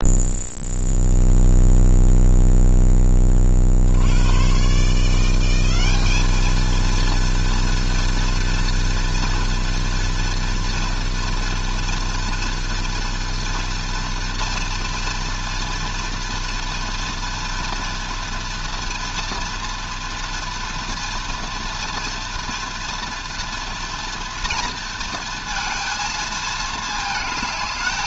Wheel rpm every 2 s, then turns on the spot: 0, 0, 140, 230, 230, 230, 230, 230, 230, 230, 230, 230, 230, 220.
none